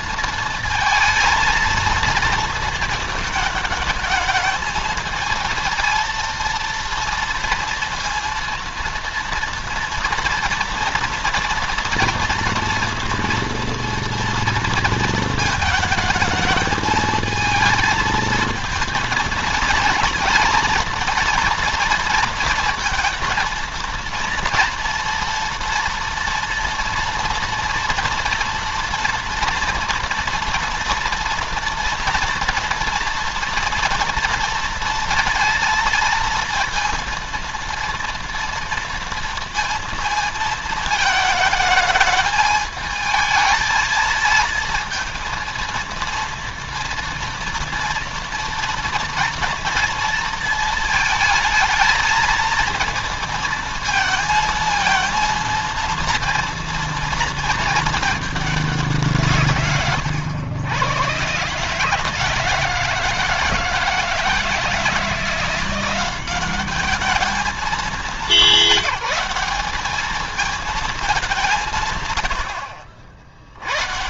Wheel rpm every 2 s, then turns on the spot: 230, 230, 220, 230, 230, 230, 230, 230, 220, 220, 220, 230, 240, 240, 230, 230, 240, 230, 230, 230, 220, 220, 230, 230, 230, 220, 230, 230, 230, 190, 110, 160, 160, 200, 200, 220, 60.
72-74